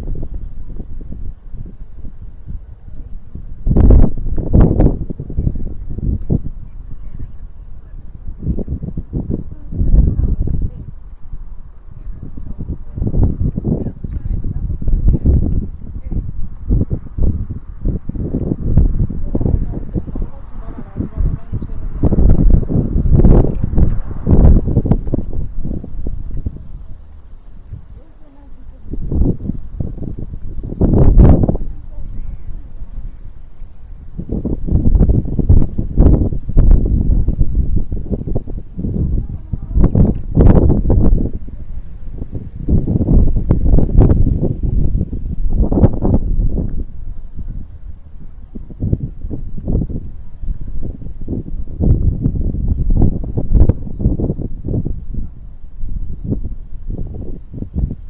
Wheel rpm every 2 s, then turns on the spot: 0, 0, 0, 0, 0, 0, 0, 0, 0, 0, 0, 0, 0, 0, 0, 0, 0, 0, 0, 0, 0, 0, 0, 0, 0, 0, 0, 0, 0.
none